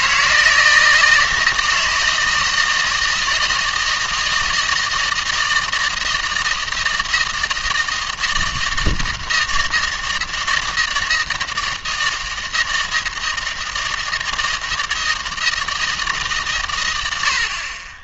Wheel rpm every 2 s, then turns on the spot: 160, 160, 160, 160, 160, 160, 160, 160, 110.
none